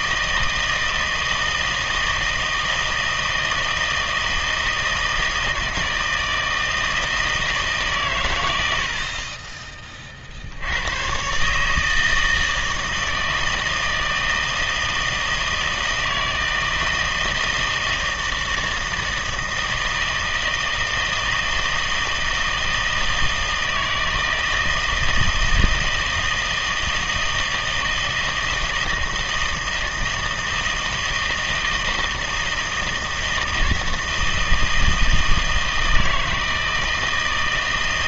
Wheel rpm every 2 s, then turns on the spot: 160, 160, 160, 160, 80, 90, 160, 160, 160, 160, 160, 160, 160, 160, 160, 160, 160, 160, 160.
none